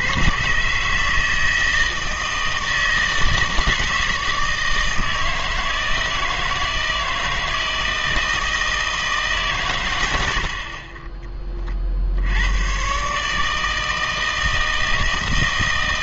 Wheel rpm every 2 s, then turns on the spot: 130, 160, 160, 160, 160, 50, 110, 160.
10-12